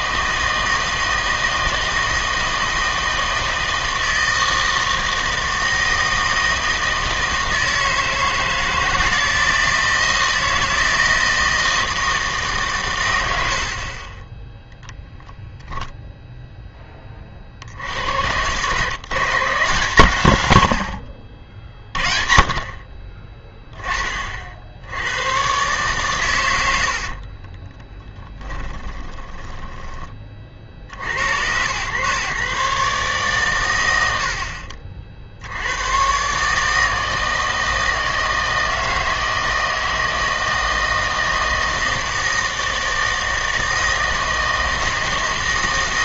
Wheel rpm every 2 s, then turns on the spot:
160, 160, 160, 160, 160, 160, 140, 10, 0, 120, 100, 40, 70, 70, 10, 60, 140, 50, 150, 160, 160, 160, 160.
28-30